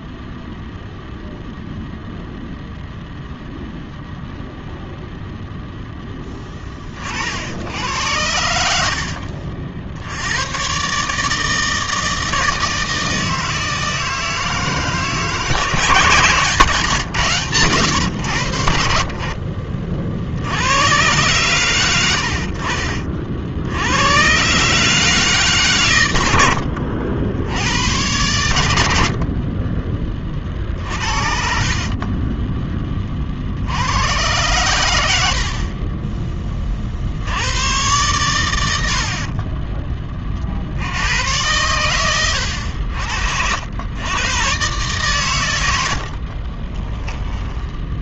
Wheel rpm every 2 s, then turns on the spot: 0, 0, 0, 20, 80, 120, 160, 160, 150, 70, 80, 50, 140, 80, 100, 40, 10, 110, 30, 90, 60, 90, 130, 30.
8-10 26-28 30-32 46-48